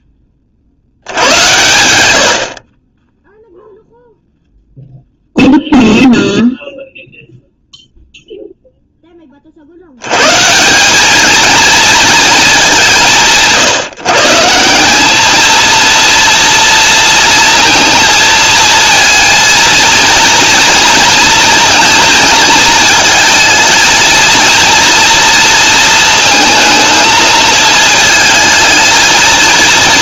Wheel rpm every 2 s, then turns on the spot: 70, 40, 0, 0, 0, 190, 200, 180, 230, 230, 230, 230, 230, 220, 220.
none